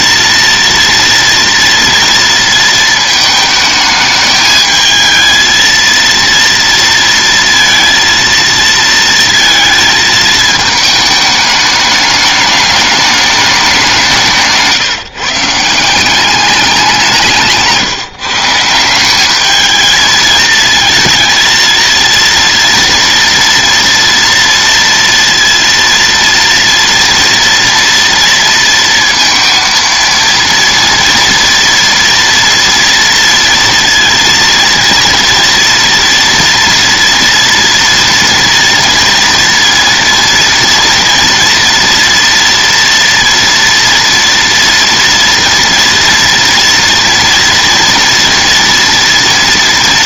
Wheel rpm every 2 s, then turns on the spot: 230, 220, 220, 230, 230, 210, 210, 140, 190, 170, 230, 240, 230, 230, 230, 230, 230, 230, 230, 230, 230, 230, 230, 230, 230.
none